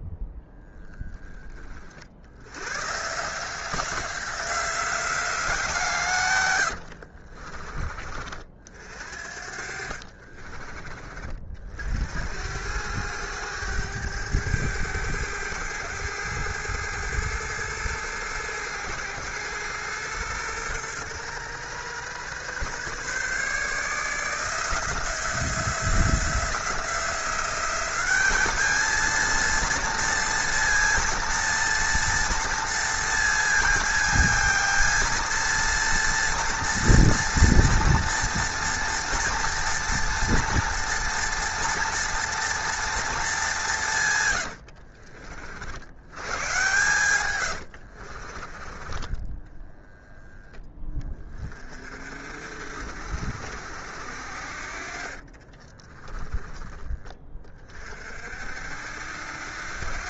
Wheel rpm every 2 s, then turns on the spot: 10, 120, 180, 80, 60, 30, 90, 100, 110, 110, 120, 130, 170, 170, 220, 230, 230, 230, 230, 230, 230, 230, 80, 120, 30, 10, 60, 50, 20, 70.
6-8 44-46 54-56